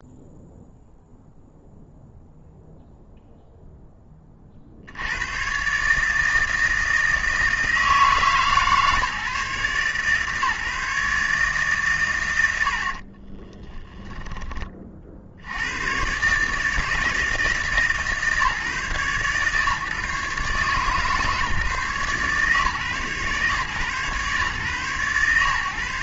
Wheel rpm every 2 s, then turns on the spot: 0, 0, 60, 160, 150, 150, 80, 30, 160, 150, 150, 140, 130.
none